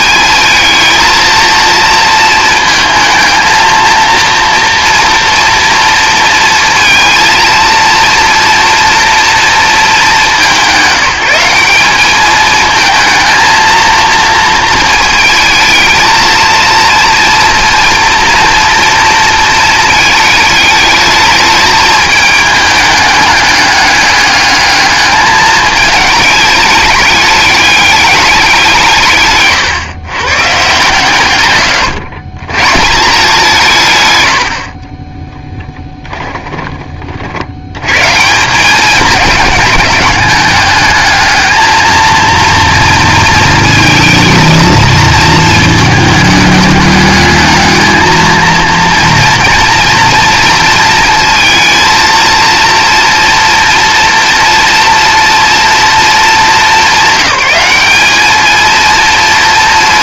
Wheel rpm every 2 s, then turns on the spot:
220, 220, 230, 230, 240, 180, 220, 220, 230, 240, 220, 210, 210, 210, 180, 130, 150, 40, 30, 190, 210, 230, 230, 210, 230, 230, 240, 230, 210, 230.
34-36